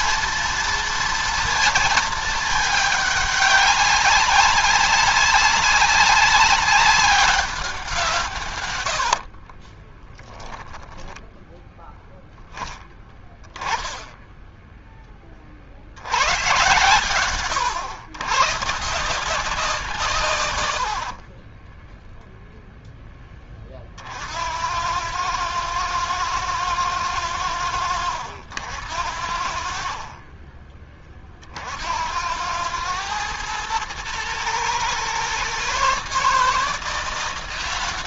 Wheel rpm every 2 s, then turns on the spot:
230, 220, 190, 190, 120, 10, 0, 0, 110, 140, 90, 0, 90, 110, 80, 20, 100, 120, 160.
8-12